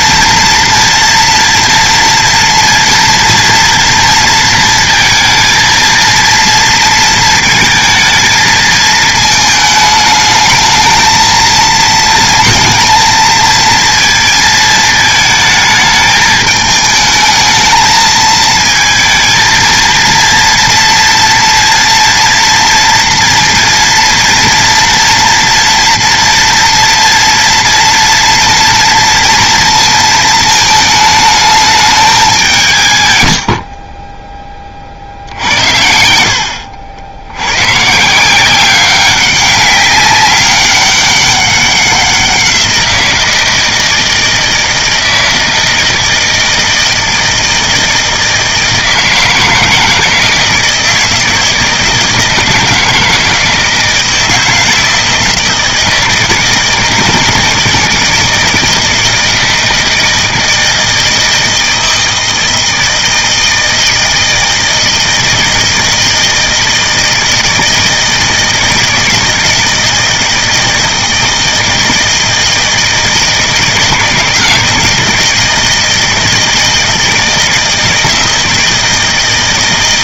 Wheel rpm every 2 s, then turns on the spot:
230, 230, 230, 230, 220, 220, 230, 220, 220, 220, 230, 230, 230, 230, 230, 220, 150, 30, 70, 190, 200, 180, 160, 160, 160, 160, 160, 160, 160, 160, 160, 160, 160, 160, 160, 160, 160, 160, 160, 160.
none